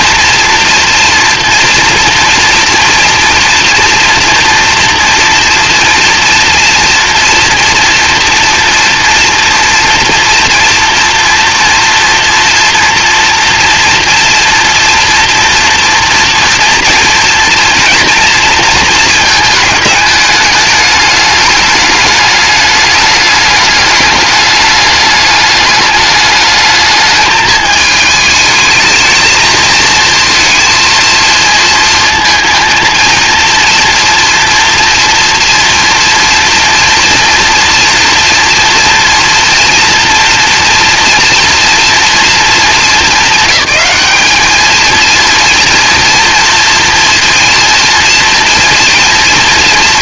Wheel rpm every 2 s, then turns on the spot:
230, 230, 230, 230, 230, 230, 240, 230, 240, 230, 210, 200, 210, 210, 220, 230, 230, 230, 230, 230, 230, 210, 220, 230, 230.
none